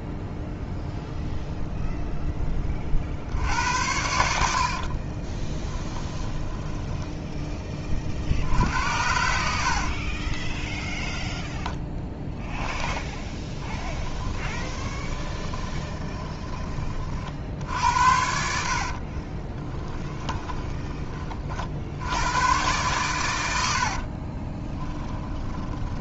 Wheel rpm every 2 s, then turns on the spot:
0, 20, 60, 10, 70, 10, 10, 20, 20, 60, 20, 110, 10.
4-8 10-16 24-26